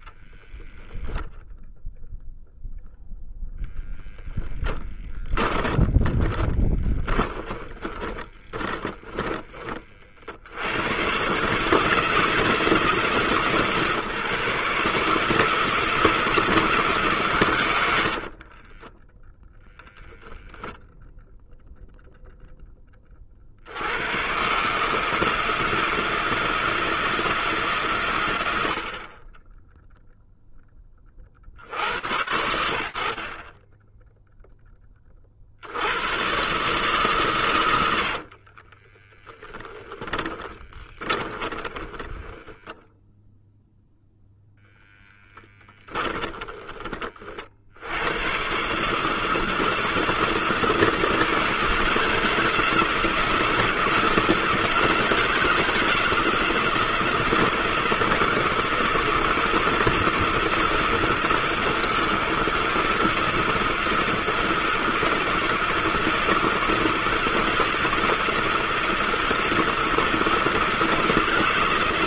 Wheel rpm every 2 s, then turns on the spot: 0, 0, 20, 20, 20, 70, 150, 150, 170, 30, 0, 10, 140, 160, 70, 10, 70, 10, 140, 40, 20, 0, 0, 30, 150, 170, 170, 170, 170, 170, 160, 160, 160, 160, 160, 160.
4-10 18-20 38-42